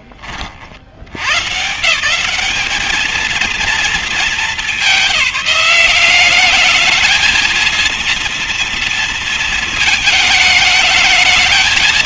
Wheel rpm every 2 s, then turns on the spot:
40, 180, 220, 200, 230, 220.
none